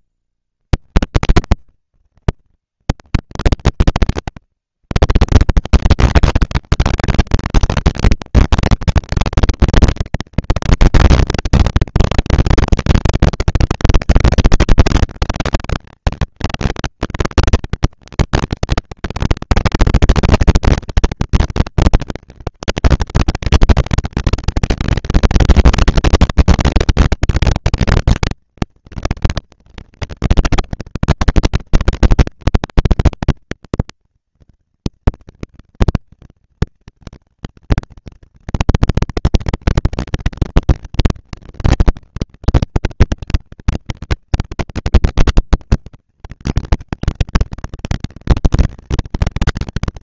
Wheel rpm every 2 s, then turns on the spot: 100, 110, 110, 210, 220, 230, 230, 220, 220, 230, 230, 220, 220, 240, 230, 230, 240, 230, 230, 230, 230, 200, 190, 210, 220.
none